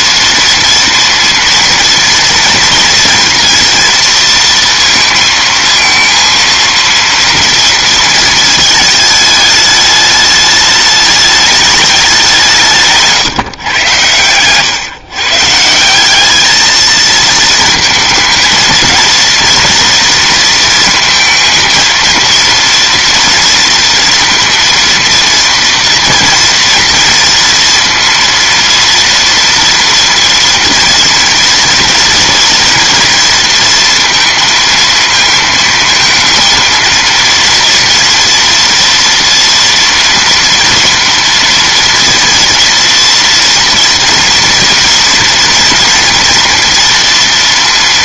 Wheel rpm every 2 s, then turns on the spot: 230, 240, 230, 230, 220, 210, 180, 120, 210, 230, 230, 230, 230, 240, 230, 230, 230, 230, 230, 230, 230, 230, 230, 230.
none